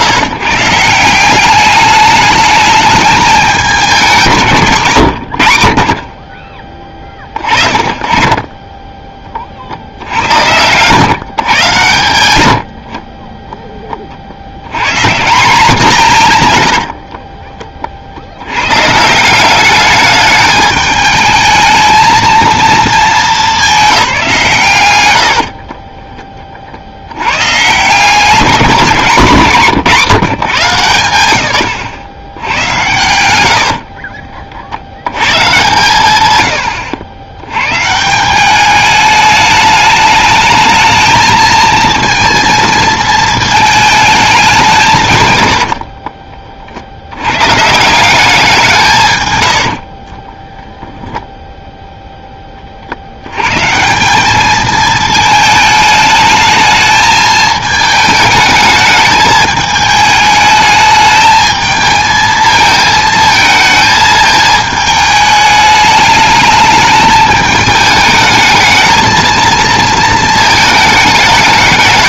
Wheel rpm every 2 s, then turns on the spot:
150, 210, 160, 30, 20, 100, 90, 100, 100, 110, 210, 220, 110, 30, 190, 150, 100, 60, 110, 200, 220, 230, 180, 50, 180, 10, 30, 220, 220, 210, 210, 220, 220, 210, 220, 220.
4-6 16-18 50-52